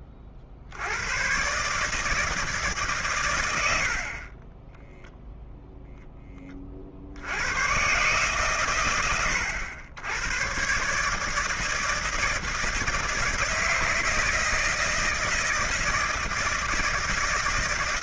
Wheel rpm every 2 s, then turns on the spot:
60, 150, 10, 50, 110, 130, 160, 160, 160.
none